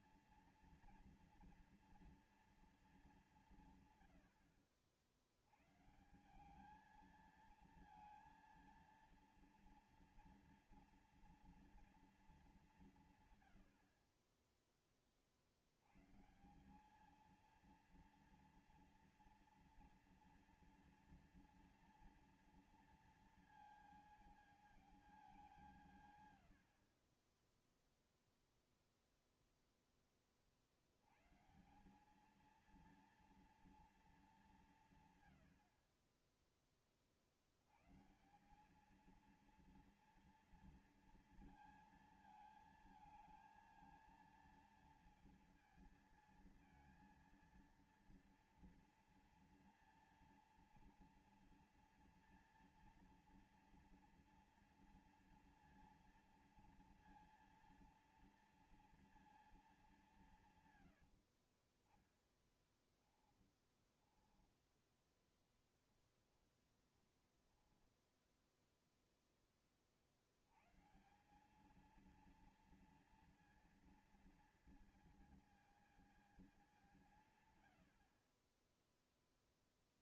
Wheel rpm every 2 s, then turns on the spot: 230, 230, 80, 190, 230, 230, 200, 20, 160, 230, 230, 230, 220, 90, 0, 50, 220, 190, 20, 170, 230, 220, 230, 230, 230, 230, 230, 230, 230, 230, 140, 10, 20, 20, 0, 90, 230, 230, 200, 30.
62-64 66-68